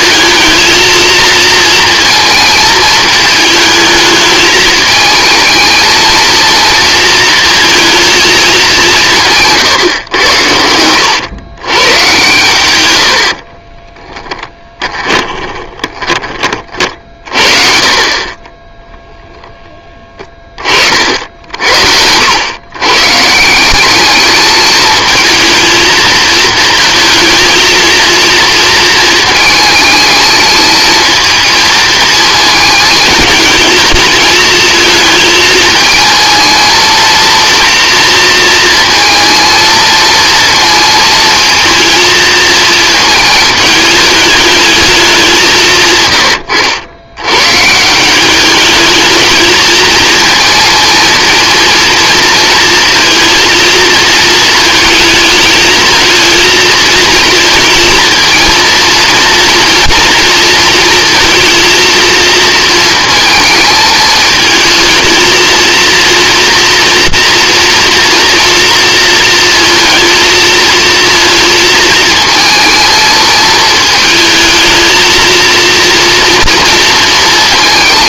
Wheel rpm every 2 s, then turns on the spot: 230, 220, 220, 230, 180, 90, 90, 20, 40, 0, 50, 130, 220, 220, 230, 220, 220, 220, 230, 230, 230, 220, 210, 90, 210, 230, 230, 220, 230, 230, 230, 220, 220, 230, 230, 230, 220, 220, 230.
14-16